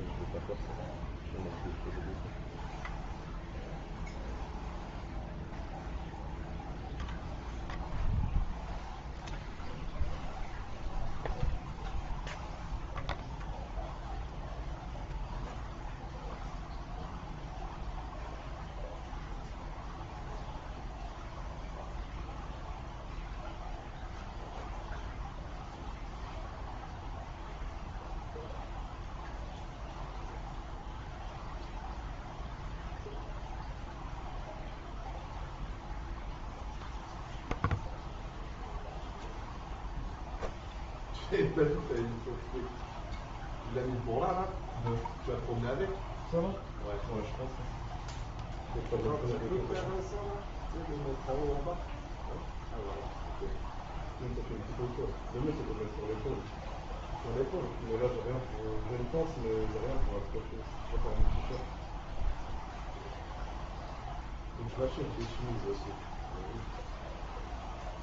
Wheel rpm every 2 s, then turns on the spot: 0, 0, 0, 0, 0, 0, 0, 0, 0, 0, 0, 0, 0, 0, 0, 0, 0, 0, 0, 0, 0, 0, 0, 0, 0, 0, 0, 0, 0, 0, 0, 0, 0, 0.
none